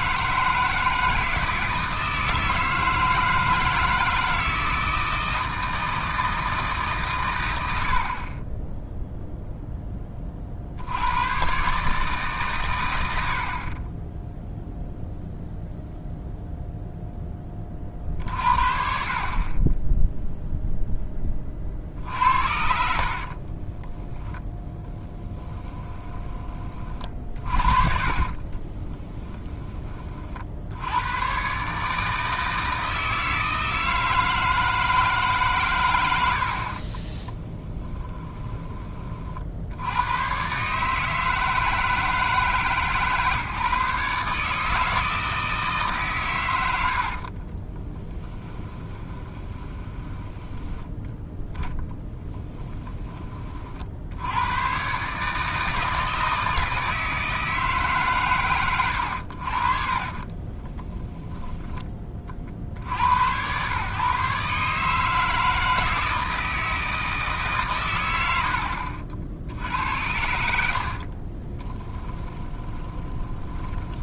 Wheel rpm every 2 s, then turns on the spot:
160, 160, 160, 160, 20, 50, 120, 0, 0, 50, 0, 70, 10, 30, 30, 70, 160, 160, 50, 20, 140, 150, 150, 90, 20, 10, 10, 110, 160, 110, 20, 60, 150, 160, 40, 80, 20.
22-26 28-30 48-50 60-62 72-74